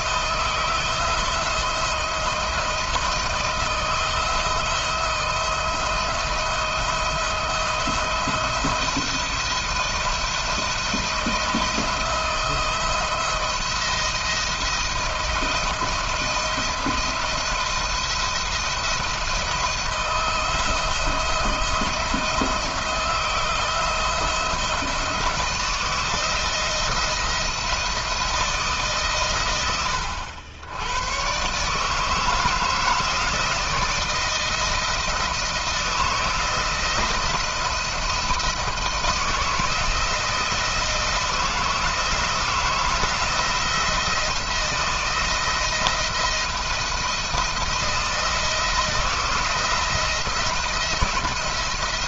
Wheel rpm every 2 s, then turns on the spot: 160, 170, 160, 170, 170, 170, 170, 170, 170, 170, 170, 160, 170, 170, 160, 90, 160, 170, 160, 160, 160, 160, 160, 170, 170, 170.
none